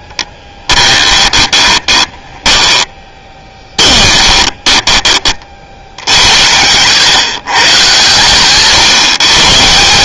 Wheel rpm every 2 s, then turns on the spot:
20, 10, 20, 90, 140.
0-8